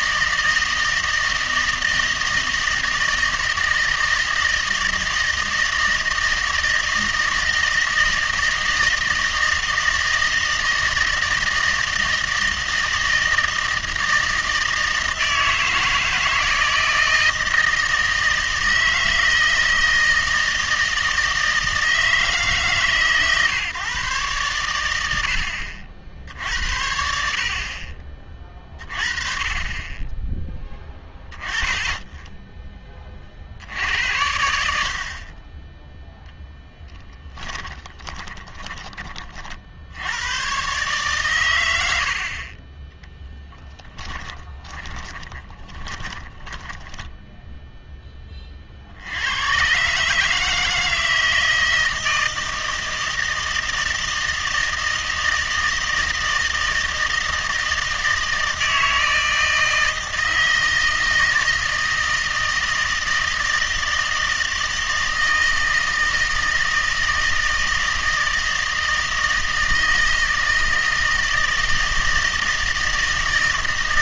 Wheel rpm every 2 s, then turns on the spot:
160, 160, 160, 160, 160, 160, 160, 160, 160, 160, 160, 150, 100, 70, 30, 10, 10, 70, 10, 20, 140, 20, 10, 10, 60, 160, 160, 160, 160, 160, 160, 160, 160, 160, 160, 160, 160.
36-38 44-48